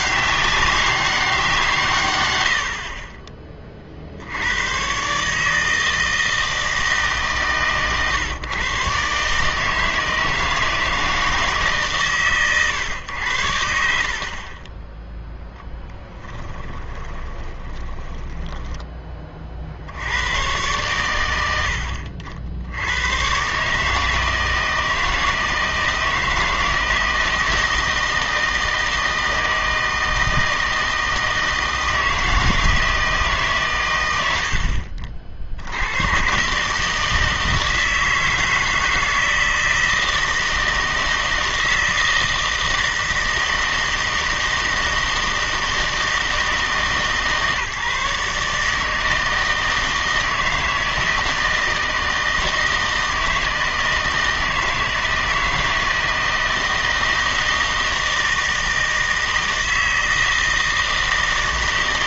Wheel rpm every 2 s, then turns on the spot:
200, 80, 110, 160, 130, 160, 110, 20, 20, 10, 110, 80, 160, 160, 160, 160, 160, 70, 140, 160, 160, 160, 160, 150, 150, 160, 160, 160, 160, 160, 160.
16-18